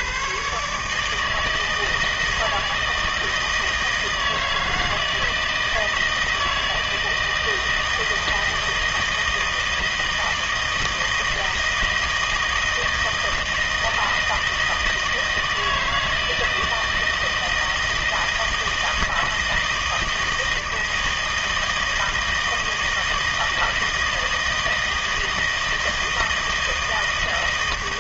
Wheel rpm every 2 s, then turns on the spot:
140, 160, 160, 160, 160, 160, 160, 160, 160, 160, 160, 160, 160, 160.
none